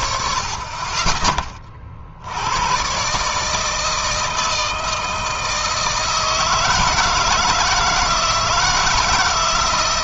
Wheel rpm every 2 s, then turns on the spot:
20, 120, 160, 160, 160.
none